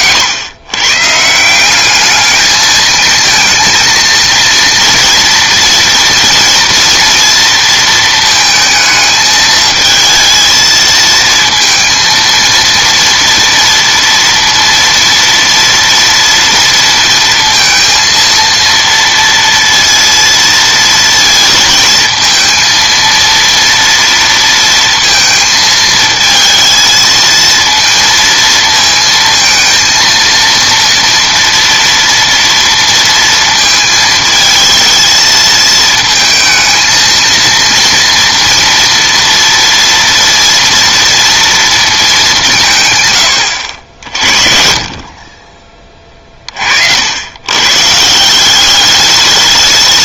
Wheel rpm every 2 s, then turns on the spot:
120, 210, 230, 230, 220, 220, 230, 230, 230, 230, 230, 230, 230, 220, 230, 230, 230, 220, 220, 230, 230, 170, 50, 50, 190.
none